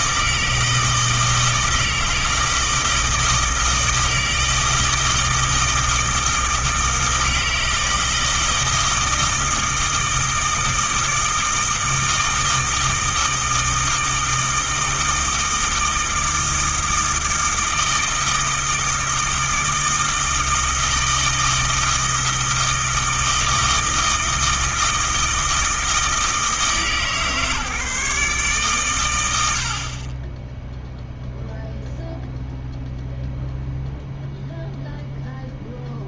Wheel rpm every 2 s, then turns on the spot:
160, 160, 160, 160, 160, 160, 160, 160, 160, 160, 160, 160, 160, 150, 120, 0, 0, 0.
none